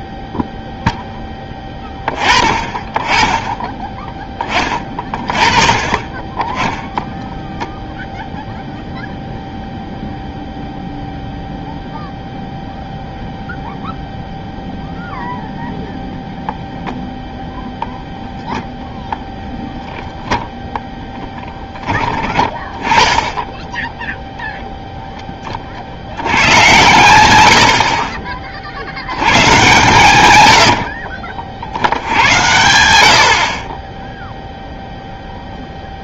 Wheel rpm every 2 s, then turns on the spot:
0, 20, 20, 10, 0, 0, 0, 0, 0, 0, 10, 10, 0, 110, 40, 90, 100, 0.
30-32